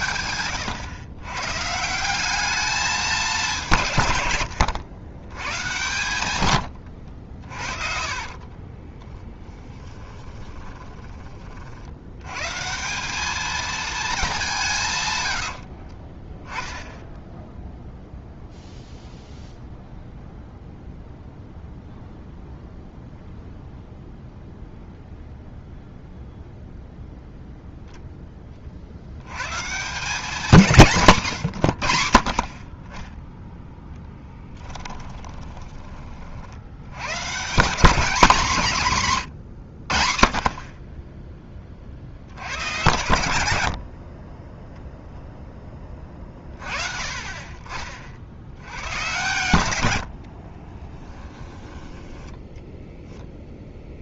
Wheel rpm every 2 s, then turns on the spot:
100, 210, 100, 110, 20, 20, 170, 140, 10, 0, 0, 0, 0, 0, 60, 170, 20, 10, 100, 170, 20, 100, 10, 30, 100, 20, 0.
6-12 34-36 50-52